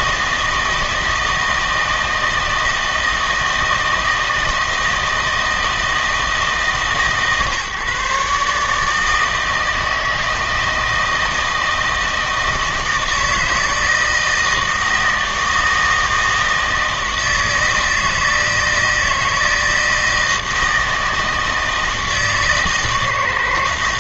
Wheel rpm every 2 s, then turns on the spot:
160, 160, 160, 150, 150, 160, 160, 160, 160, 160, 160, 150.
none